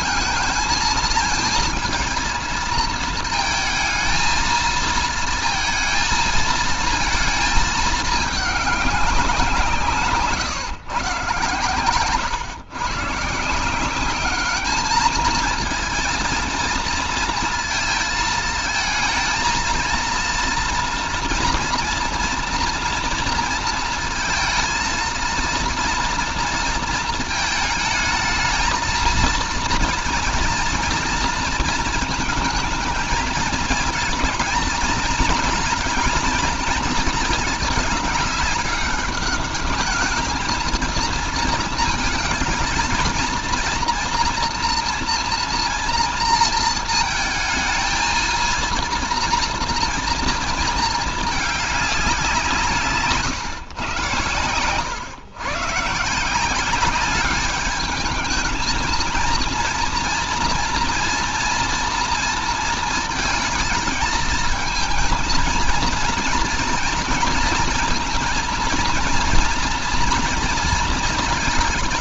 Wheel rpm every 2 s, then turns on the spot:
220, 220, 220, 220, 200, 140, 130, 210, 230, 220, 230, 230, 230, 230, 220, 230, 220, 230, 220, 200, 220, 220, 230, 230, 230, 220, 160, 110, 190, 220, 230, 230, 230, 230, 230, 230.
none